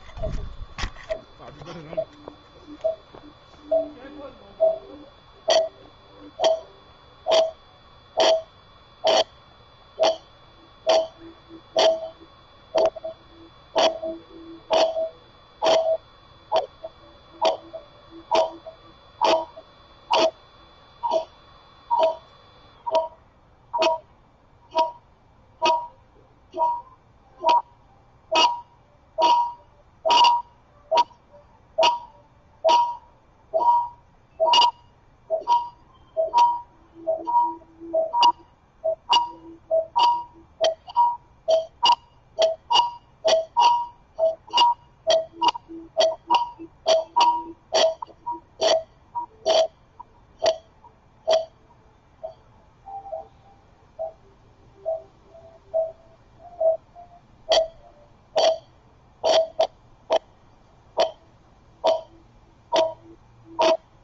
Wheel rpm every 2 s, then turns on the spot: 0, 0, 0, 0, 0, 0, 0, 0, 0, 0, 0, 0, 0, 0, 0, 0, 0, 0, 0, 0, 0, 0, 0, 0, 0, 0, 0, 0, 0, 0, 0, 0.
none